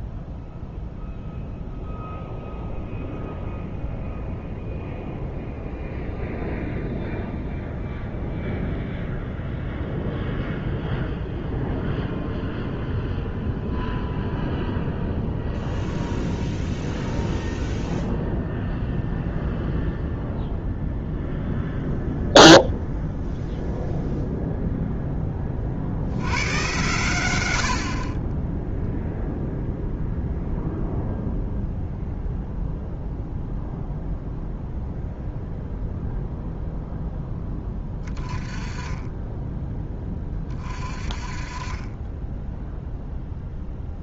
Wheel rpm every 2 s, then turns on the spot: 0, 0, 0, 0, 0, 0, 0, 0, 0, 0, 0, 0, 0, 120, 10, 0, 0, 0, 0, 20, 30, 0.
none